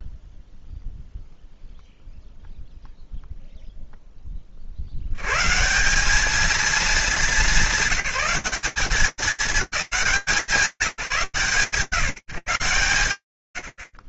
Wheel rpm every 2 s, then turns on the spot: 0, 0, 10, 200, 220, 190, 130.
none